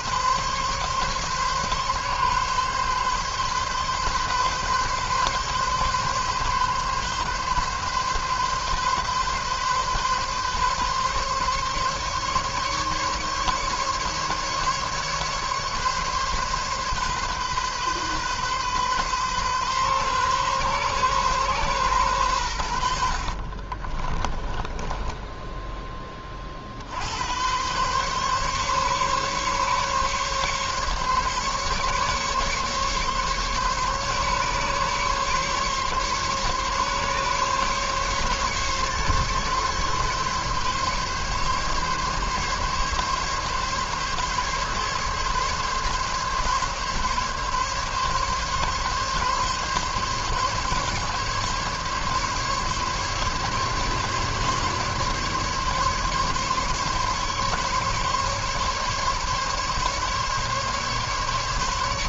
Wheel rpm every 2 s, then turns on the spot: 140, 140, 140, 130, 130, 140, 140, 140, 130, 130, 130, 40, 10, 90, 140, 140, 140, 140, 140, 140, 140, 140, 140, 140, 140, 140, 140, 140, 140, 140, 140.
22-26